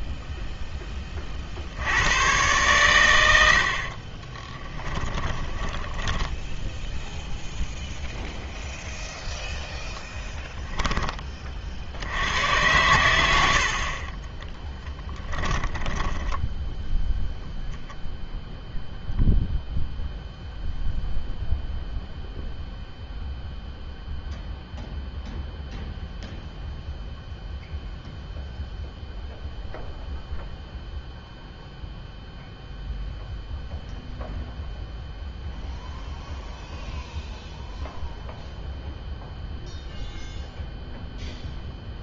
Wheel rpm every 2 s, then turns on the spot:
10, 110, 10, 0, 0, 10, 110, 10, 0, 0, 0, 0, 0, 0, 0, 0, 0, 0, 0, 0, 0.
4-6 14-16